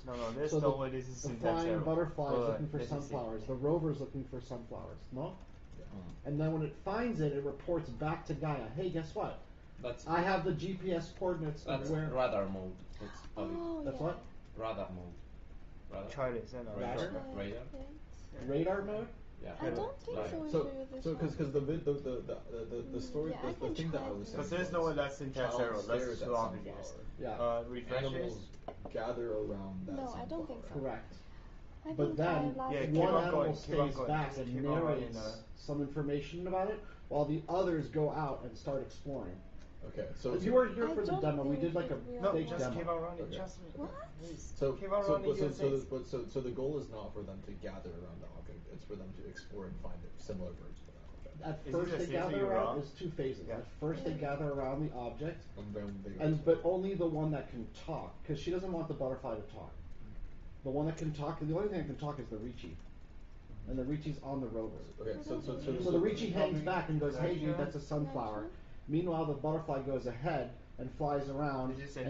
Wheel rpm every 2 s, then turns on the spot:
0, 0, 0, 0, 0, 0, 0, 0, 0, 0, 0, 0, 0, 0, 0, 0, 0, 0, 0, 0, 0, 0, 0, 0, 0, 0, 0, 0, 0, 0, 0, 0, 0, 0, 0, 0.
none